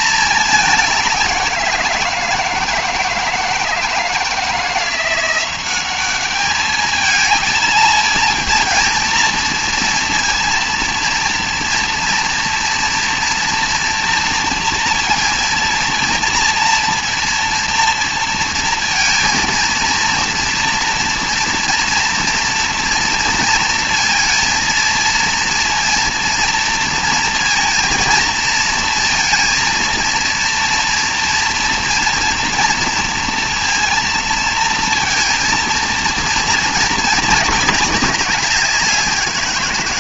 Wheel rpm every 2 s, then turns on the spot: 200, 160, 170, 220, 230, 230, 240, 230, 230, 230, 230, 240, 230, 230, 230, 230, 230, 230, 220, 190.
none